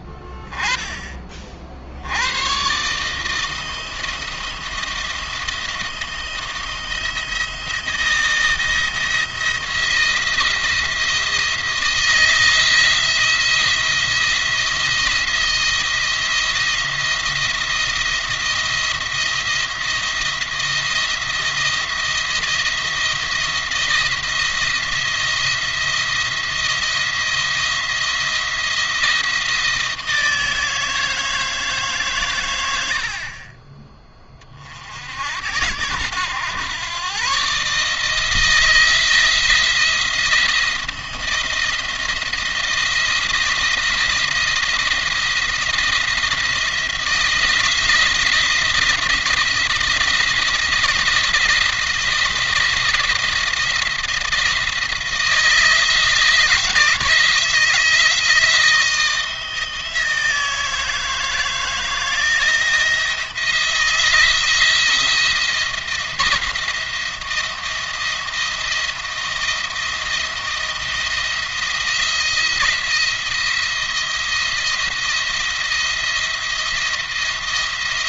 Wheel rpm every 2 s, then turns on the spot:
10, 120, 170, 170, 170, 170, 160, 170, 170, 170, 170, 170, 170, 170, 170, 160, 110, 40, 110, 160, 170, 170, 170, 170, 170, 170, 170, 170, 160, 160, 160, 160, 170, 170, 170, 170, 170, 170, 160.
none